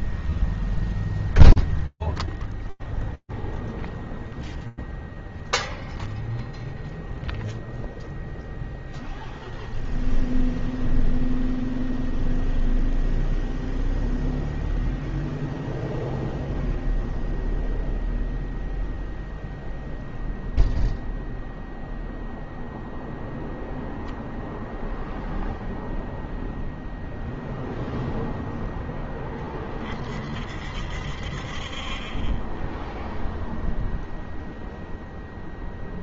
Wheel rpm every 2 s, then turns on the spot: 0, 0, 0, 0, 0, 0, 0, 0, 0, 0, 0, 0, 0, 10, 60, 10, 0, 0.
none